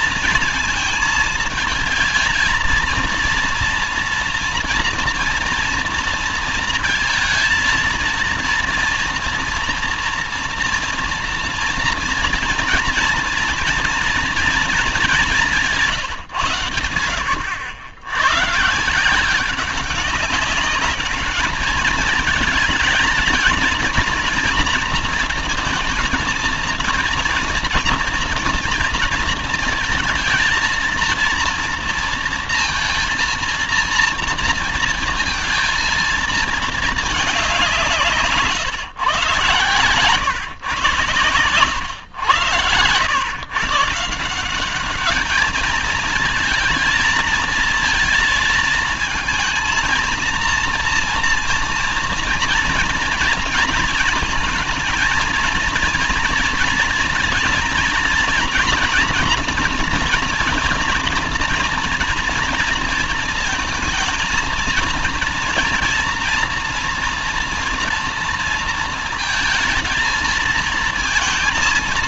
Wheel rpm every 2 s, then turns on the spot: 230, 230, 230, 230, 230, 230, 230, 200, 90, 170, 200, 220, 230, 230, 220, 230, 230, 230, 210, 130, 120, 110, 200, 230, 230, 240, 240, 230, 230, 230, 240, 230, 230, 230, 230, 230.
none